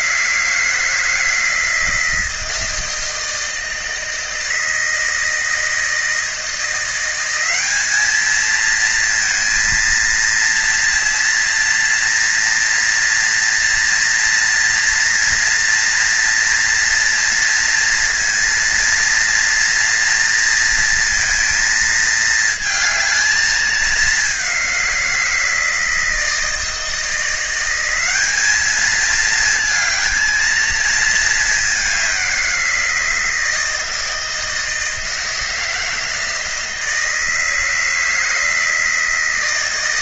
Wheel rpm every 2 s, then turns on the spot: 180, 160, 160, 160, 200, 230, 230, 230, 230, 230, 230, 220, 210, 160, 180, 220, 200, 160, 160, 160.
none